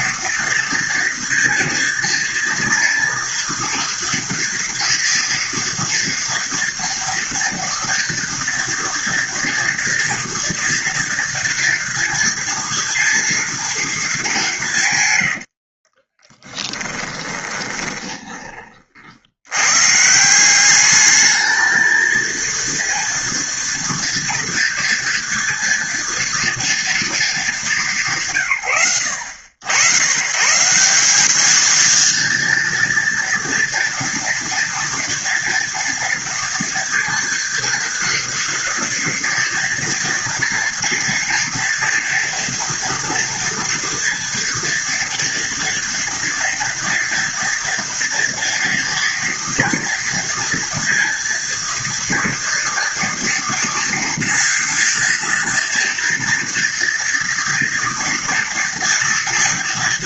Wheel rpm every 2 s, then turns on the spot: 230, 230, 230, 240, 230, 230, 230, 140, 20, 50, 210, 230, 230, 230, 80, 180, 230, 230, 230, 230, 230, 230, 230, 230, 230, 230, 230, 230, 230, 230.
16-18